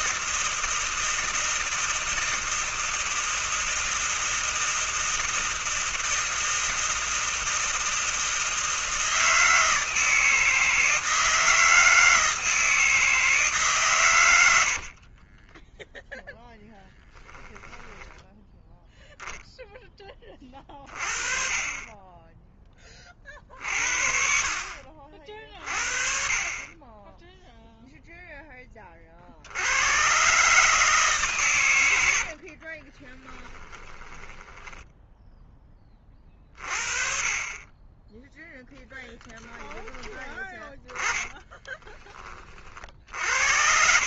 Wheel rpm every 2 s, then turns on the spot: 160, 160, 160, 160, 160, 160, 160, 40, 10, 0, 30, 30, 50, 20, 40, 140, 20, 10, 40, 10, 20, 80.
14-16 32-34 40-42